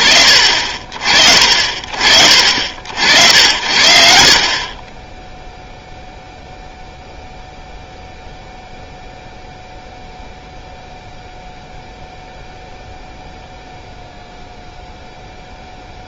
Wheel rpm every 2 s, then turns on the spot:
40, 90, 0, 0, 0, 0, 0, 0.
none